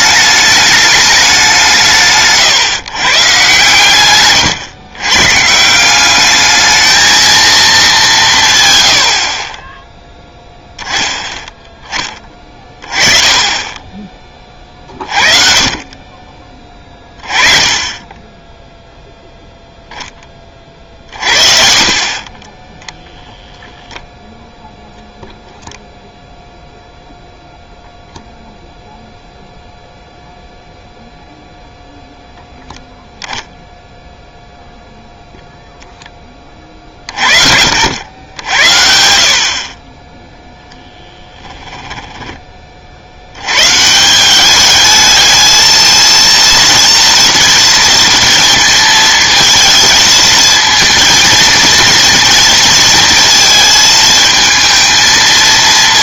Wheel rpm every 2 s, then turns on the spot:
210, 150, 120, 220, 110, 0, 20, 40, 30, 10, 50, 10, 0, 0, 0, 0, 0, 0, 40, 70, 10, 50, 210, 230, 230, 230, 230, 220.
40-42